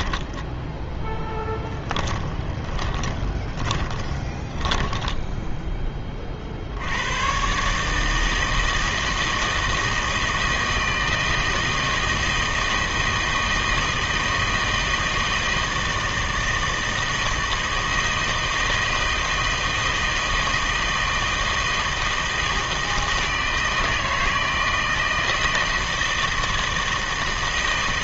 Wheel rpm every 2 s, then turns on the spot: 10, 20, 10, 70, 160, 160, 160, 160, 160, 160, 160, 160, 160, 160.
0-6